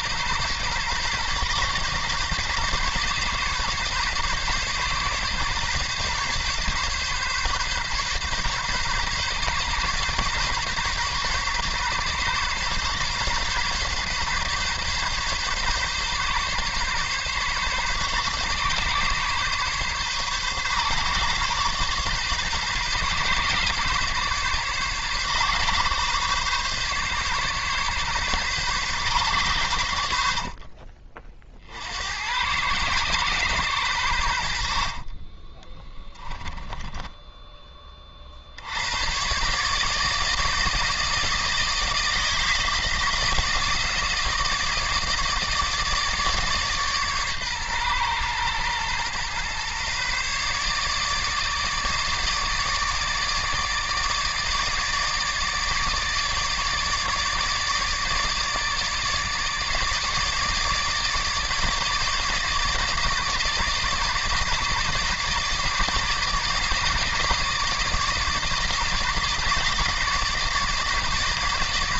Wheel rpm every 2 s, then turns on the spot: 130, 140, 140, 140, 140, 140, 140, 140, 140, 140, 130, 130, 140, 140, 130, 50, 110, 70, 10, 80, 160, 160, 160, 150, 120, 140, 150, 160, 150, 150, 150, 150, 150, 150, 160, 150.
34-38